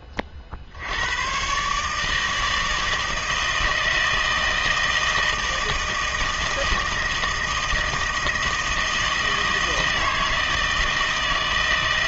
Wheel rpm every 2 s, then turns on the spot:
70, 160, 160, 160, 160, 160.
none